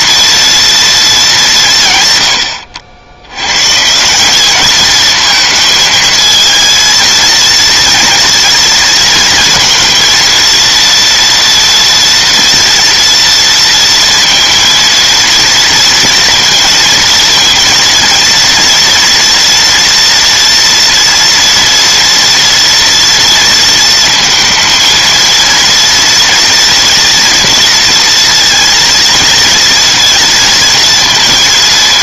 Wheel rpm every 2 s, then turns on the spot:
230, 90, 210, 230, 230, 230, 240, 230, 230, 230, 230, 240, 230, 230, 230, 230.
none